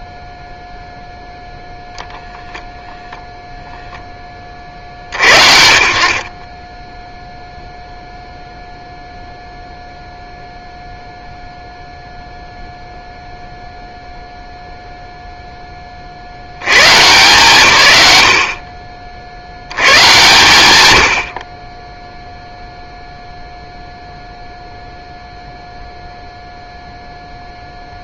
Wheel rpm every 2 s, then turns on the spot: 0, 0, 50, 0, 0, 0, 0, 0, 130, 40, 100, 0, 0, 0.
none